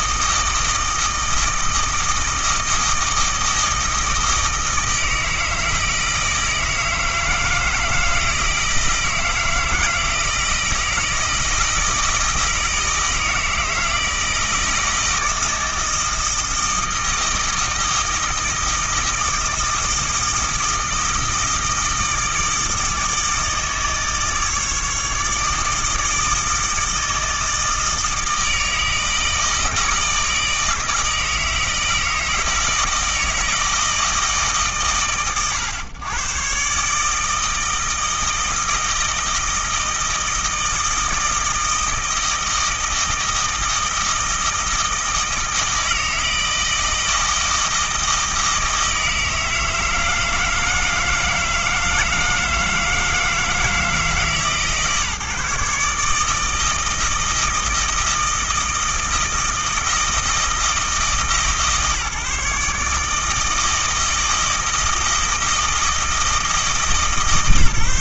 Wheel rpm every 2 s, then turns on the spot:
160, 160, 160, 160, 160, 160, 160, 160, 160, 160, 160, 160, 150, 160, 160, 160, 160, 130, 150, 160, 170, 160, 160, 160, 160, 160, 160, 140, 160, 160, 160, 150, 160, 150.
none